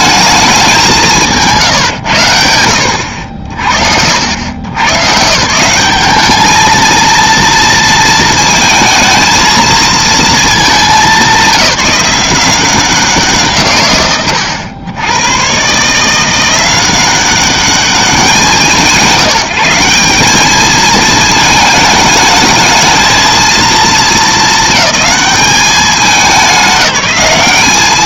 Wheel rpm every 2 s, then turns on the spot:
200, 90, 110, 220, 230, 200, 180, 90, 180, 180, 210, 220, 190, 180.
none